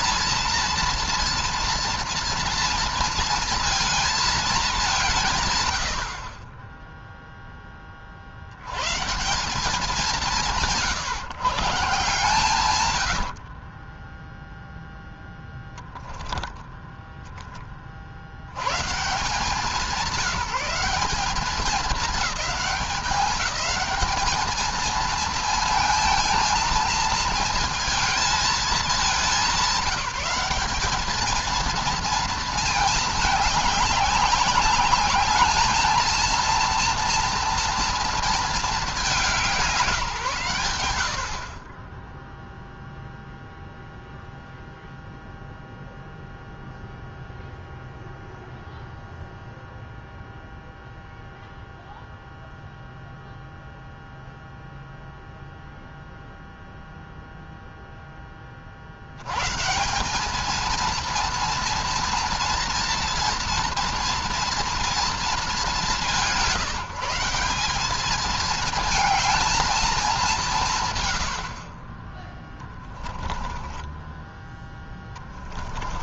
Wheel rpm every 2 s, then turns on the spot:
230, 230, 200, 20, 60, 160, 120, 0, 10, 140, 200, 200, 220, 230, 210, 200, 220, 200, 230, 220, 130, 0, 0, 0, 0, 0, 0, 0, 0, 50, 220, 230, 230, 150, 220, 160, 10, 10.
12-14 72-74